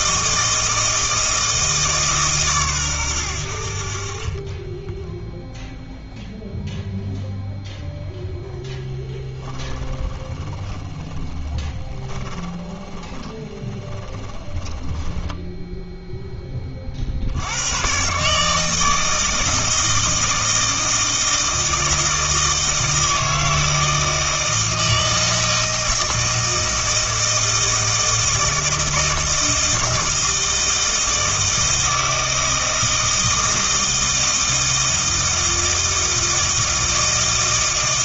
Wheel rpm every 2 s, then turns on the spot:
160, 120, 10, 0, 10, 20, 10, 10, 30, 160, 160, 160, 160, 160, 160, 160, 160, 160, 160.
4-6 10-16